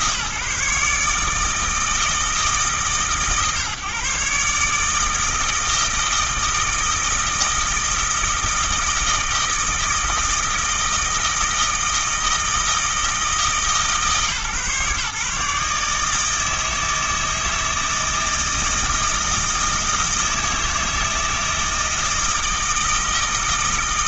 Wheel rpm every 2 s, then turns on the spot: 140, 140, 150, 160, 160, 160, 160, 140, 160, 160, 160, 160.
none